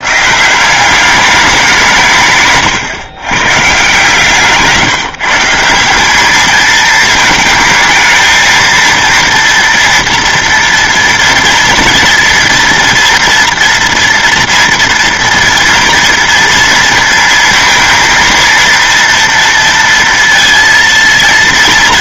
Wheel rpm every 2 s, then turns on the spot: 170, 140, 150, 220, 230, 230, 230, 230, 230, 230, 230.
none